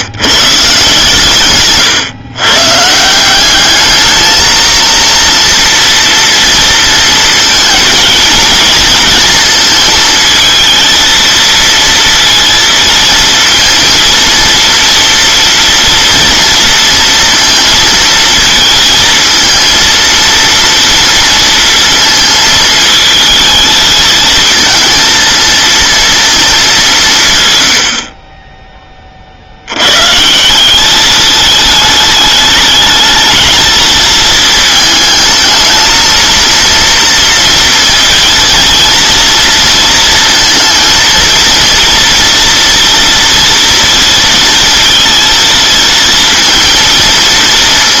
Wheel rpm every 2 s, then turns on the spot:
150, 140, 230, 230, 230, 230, 230, 230, 230, 220, 230, 220, 230, 210, 10, 180, 210, 220, 230, 230, 230, 230, 220, 230.
none